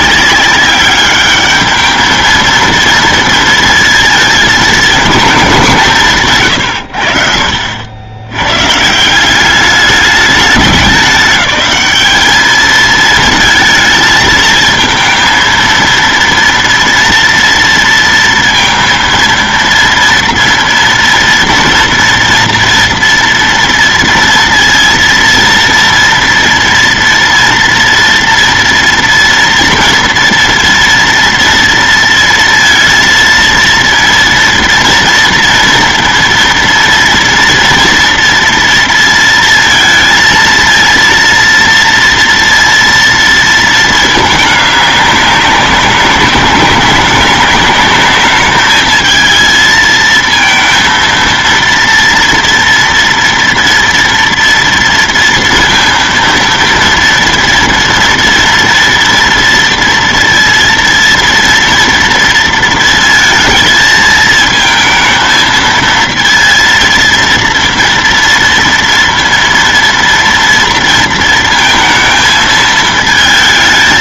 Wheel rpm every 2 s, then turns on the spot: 200, 230, 220, 100, 140, 190, 210, 220, 240, 230, 240, 230, 230, 230, 230, 240, 230, 230, 230, 230, 230, 230, 200, 200, 220, 230, 230, 230, 230, 230, 230, 230, 220, 230, 230, 230, 220.
none